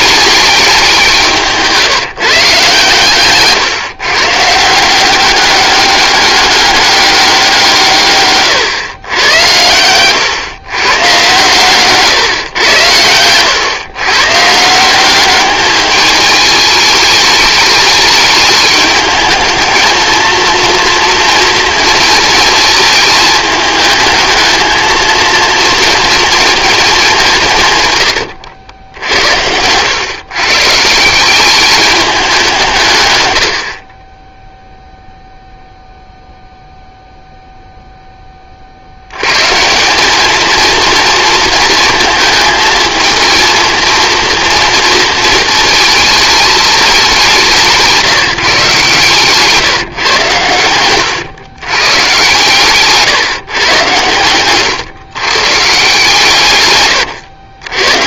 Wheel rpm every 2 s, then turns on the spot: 200, 150, 160, 200, 130, 130, 120, 150, 210, 210, 230, 220, 220, 220, 90, 150, 160, 0, 0, 40, 220, 220, 230, 210, 150, 100, 140, 120, 130.
50-52